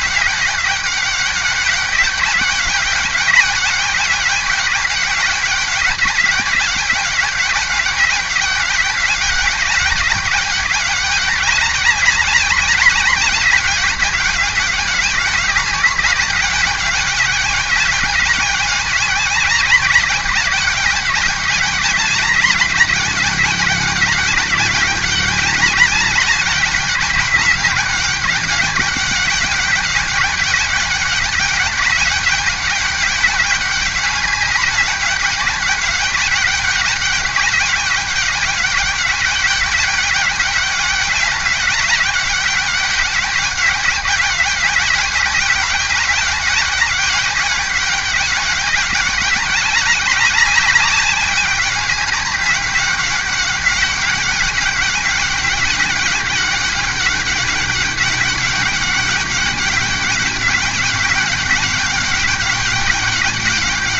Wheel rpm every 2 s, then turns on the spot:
190, 200, 200, 200, 200, 200, 200, 190, 200, 200, 200, 200, 200, 200, 200, 200, 190, 200, 200, 200, 200, 200, 200, 200, 200, 200, 200, 200, 200, 200, 200, 200.
none